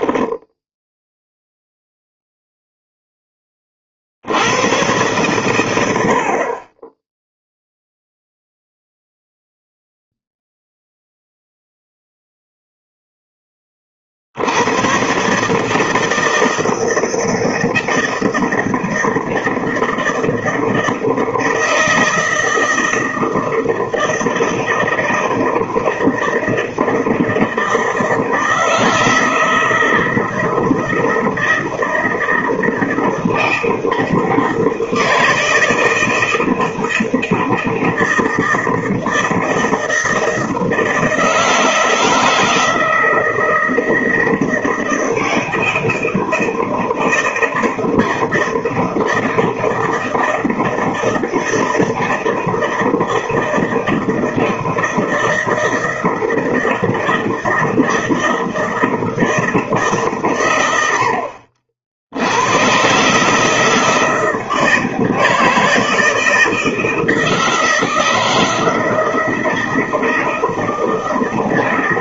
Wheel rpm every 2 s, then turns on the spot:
10, 0, 100, 30, 0, 0, 0, 90, 160, 160, 160, 160, 160, 160, 160, 160, 160, 160, 160, 160, 160, 170, 160, 160, 160, 160, 160, 160, 160, 160, 100, 120, 160, 160, 160, 160.
none